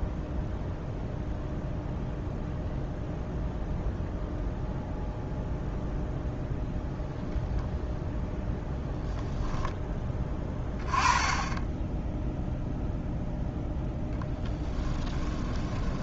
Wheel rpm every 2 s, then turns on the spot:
0, 0, 0, 0, 0, 20, 0, 10.
14-16